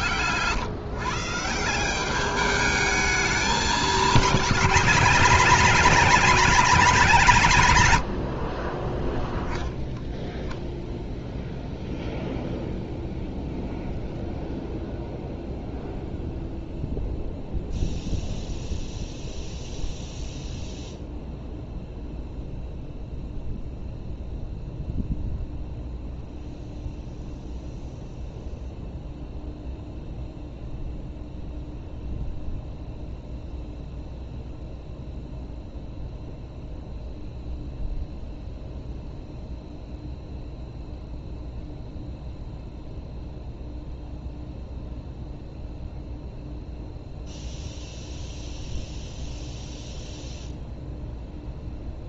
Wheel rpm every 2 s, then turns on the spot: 150, 210, 200, 220, 40, 0, 0, 0, 0, 0, 0, 0, 0, 0, 0, 0, 0, 0, 0, 0, 0, 0, 0, 0, 0, 0.
none